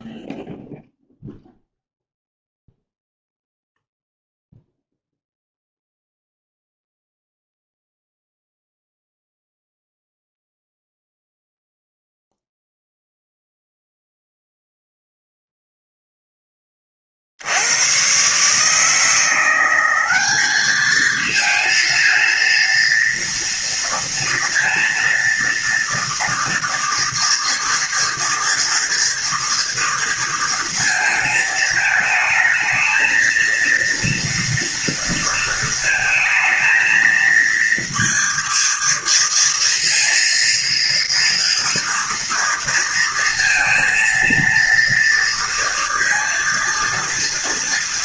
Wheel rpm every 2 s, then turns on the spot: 0, 0, 0, 0, 0, 0, 0, 0, 20, 150, 210, 230, 230, 230, 230, 230, 220, 230, 220, 230, 230, 230, 230, 230.
none